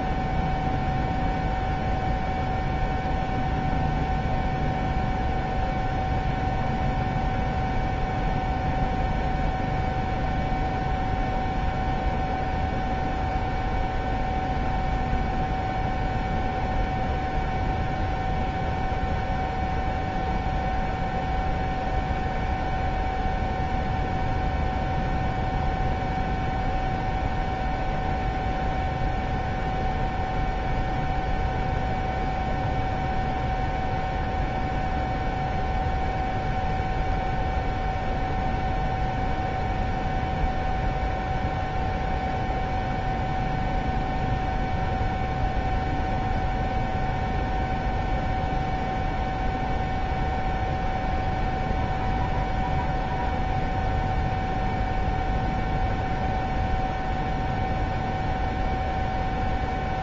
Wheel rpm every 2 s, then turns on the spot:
0, 0, 0, 0, 0, 0, 0, 0, 0, 0, 0, 0, 0, 0, 0, 0, 0, 0, 0, 0, 0, 0, 0, 0, 0, 0, 0, 0, 0, 0.
none